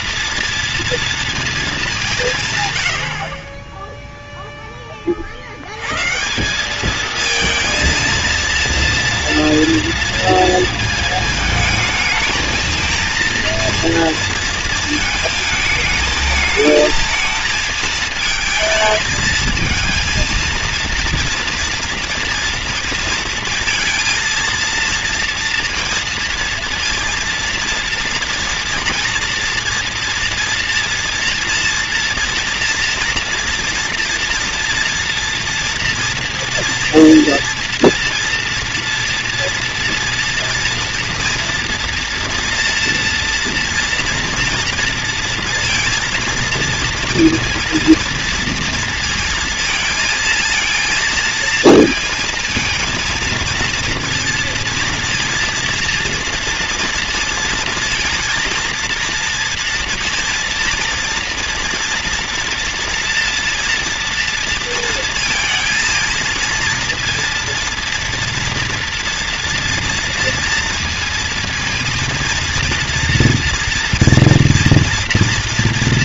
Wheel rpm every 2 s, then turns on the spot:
230, 110, 10, 200, 230, 230, 220, 220, 220, 220, 230, 230, 230, 230, 230, 230, 230, 230, 240, 230, 230, 240, 240, 230, 230, 220, 230, 230, 230, 230, 230, 240, 230, 230, 230, 230, 230, 230.
none